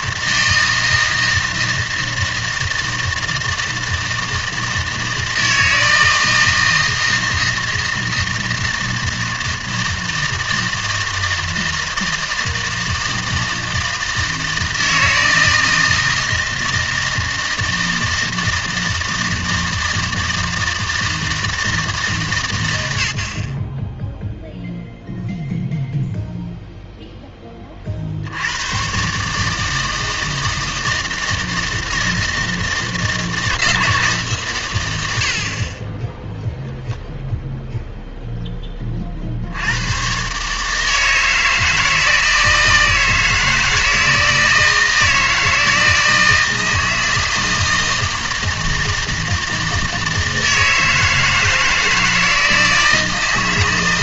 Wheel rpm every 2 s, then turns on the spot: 160, 160, 160, 160, 160, 160, 160, 160, 160, 160, 160, 110, 0, 0, 100, 160, 160, 130, 0, 10, 140, 160, 160, 160, 160, 160, 160.
none